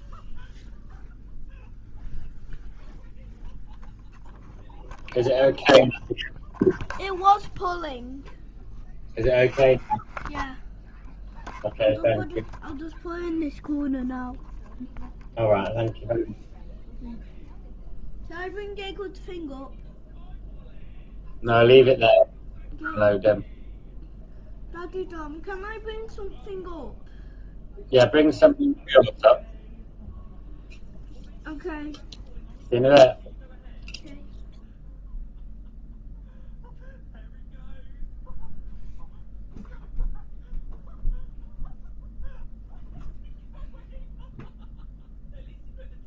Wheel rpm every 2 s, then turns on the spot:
0, 0, 0, 0, 0, 0, 0, 0, 0, 0, 0, 0, 0, 0, 0, 0, 0, 0, 0, 0, 0, 0, 0.
none